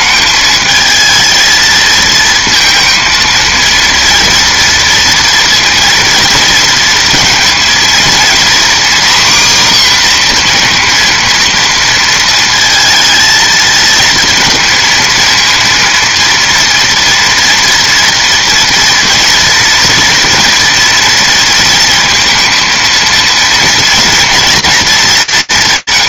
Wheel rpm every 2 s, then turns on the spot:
220, 230, 230, 230, 250, 240, 230, 220, 230, 230, 230, 230, 220.
none